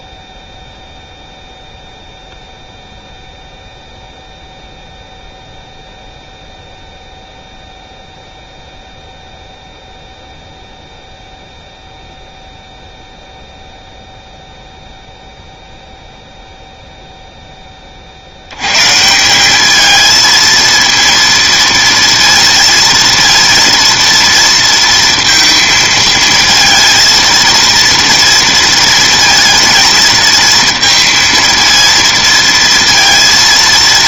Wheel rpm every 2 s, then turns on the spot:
0, 0, 0, 0, 0, 0, 0, 0, 0, 120, 220, 230, 230, 220, 230, 230, 230.
none